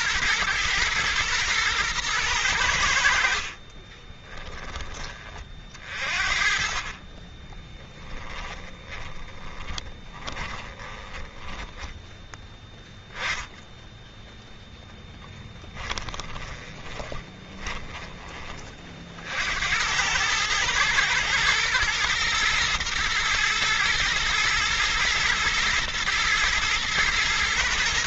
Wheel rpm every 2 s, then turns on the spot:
110, 80, 10, 40, 30, 20, 10, 0, 20, 40, 110, 120, 120, 110.
6-12 16-18